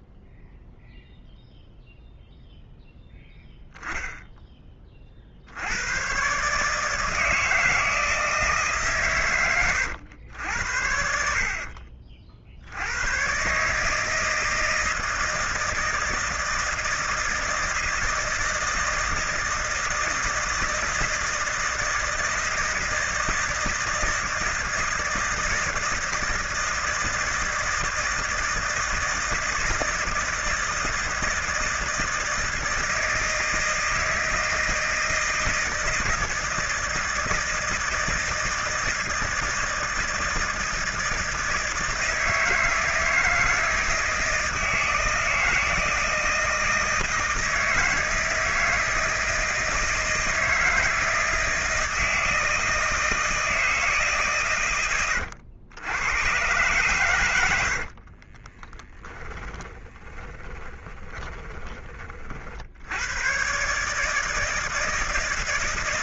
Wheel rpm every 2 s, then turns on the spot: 0, 0, 20, 140, 150, 80, 70, 160, 160, 160, 160, 160, 160, 160, 160, 160, 160, 160, 160, 160, 160, 160, 160, 160, 160, 160, 160, 120, 120, 20, 20, 60, 160.
58-62